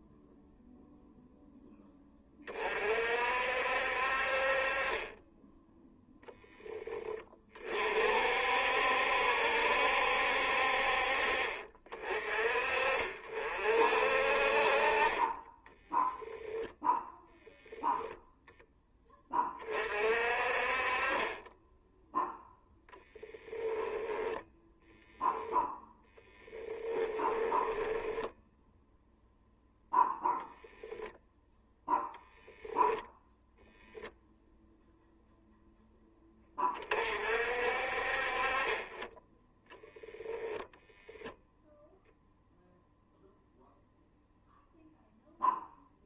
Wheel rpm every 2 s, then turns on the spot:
0, 10, 60, 10, 50, 60, 50, 40, 0, 0, 50, 0, 0, 10, 0, 0, 10, 0, 20, 30, 0, 0, 0.
26-28 32-34